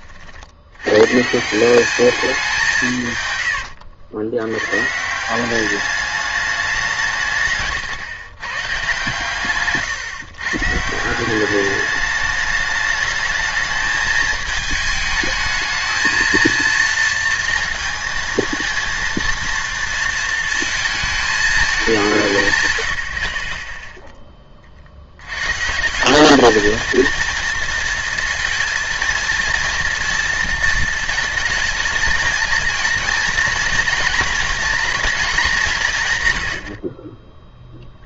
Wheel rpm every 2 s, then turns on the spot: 100, 170, 120, 190, 140, 140, 210, 220, 230, 230, 220, 110, 50, 220, 230, 230, 220, 230, 70.
none